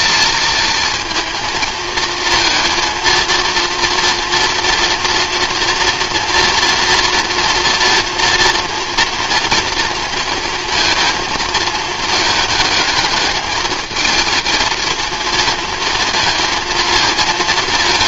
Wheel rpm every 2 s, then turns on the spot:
230, 230, 230, 230, 230, 230, 220, 230, 220.
none